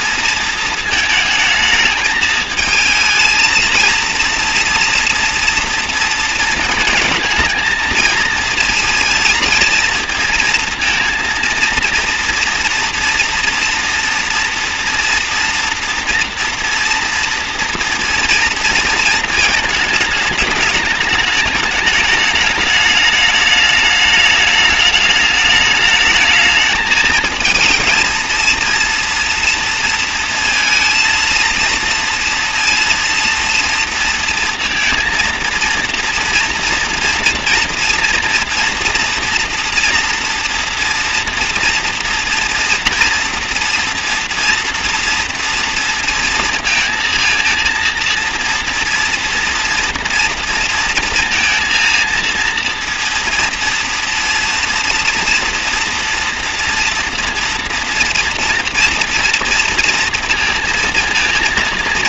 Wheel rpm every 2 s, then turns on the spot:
220, 220, 230, 230, 230, 230, 230, 230, 230, 230, 210, 210, 210, 220, 230, 230, 230, 230, 230, 230, 230, 240, 230, 230, 230, 230, 230, 230, 240, 230, 230.
none